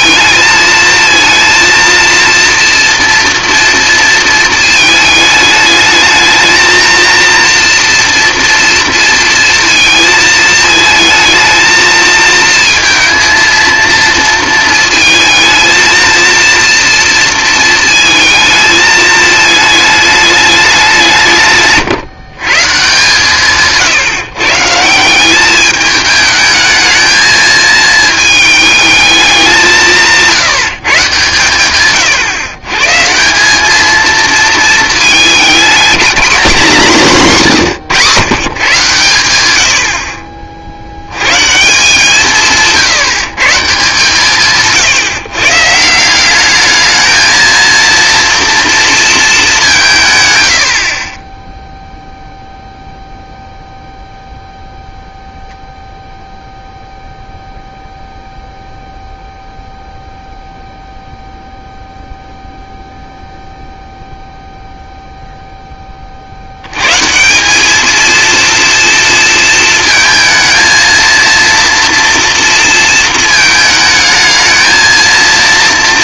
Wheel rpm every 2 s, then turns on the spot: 220, 230, 220, 230, 230, 220, 230, 220, 230, 220, 200, 140, 160, 220, 220, 160, 140, 220, 200, 140, 50, 160, 140, 210, 230, 90, 0, 0, 0, 0, 0, 0, 0, 90, 230, 220, 230, 220.
none